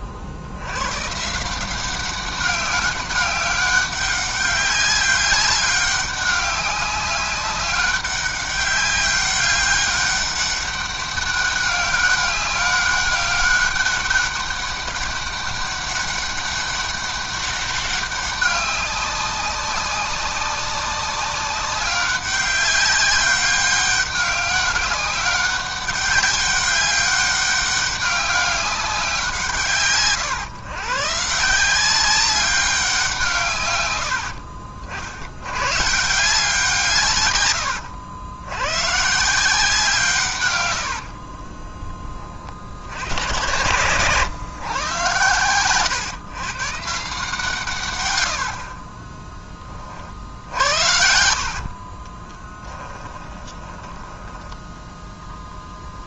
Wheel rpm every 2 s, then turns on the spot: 90, 200, 200, 200, 200, 200, 200, 200, 200, 200, 200, 200, 200, 200, 190, 130, 190, 60, 160, 120, 100, 60, 120, 140, 40, 70, 20, 10.
40-42 48-54